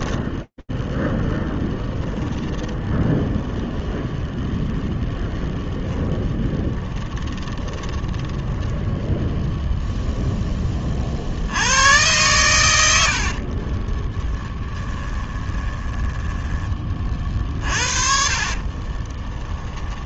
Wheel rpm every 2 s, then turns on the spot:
10, 0, 0, 10, 0, 80, 30, 10, 50, 10.
6-8 12-20